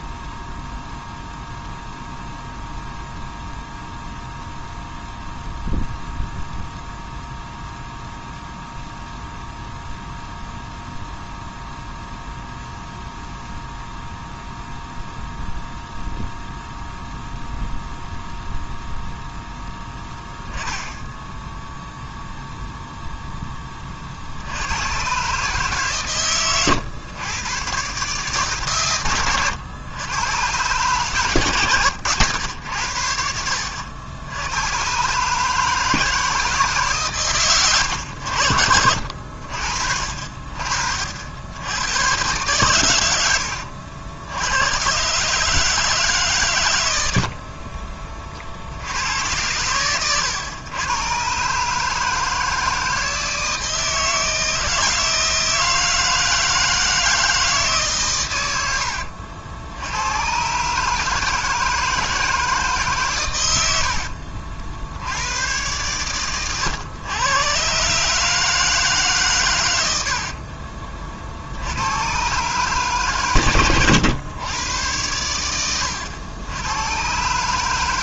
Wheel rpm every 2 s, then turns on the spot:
0, 0, 0, 0, 0, 0, 0, 0, 0, 0, 10, 0, 110, 120, 120, 130, 80, 130, 130, 60, 60, 110, 120, 90, 90, 120, 160, 160, 160, 80, 150, 140, 70, 110, 150, 40, 130, 100, 120.
none